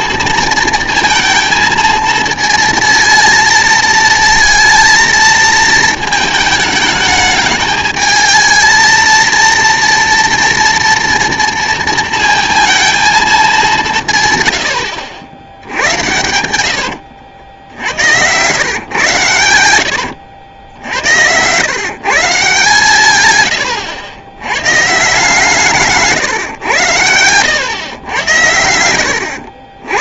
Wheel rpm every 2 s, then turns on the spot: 230, 220, 230, 220, 220, 230, 230, 100, 80, 120, 80, 150, 130, 110, 90.
16-18 20-22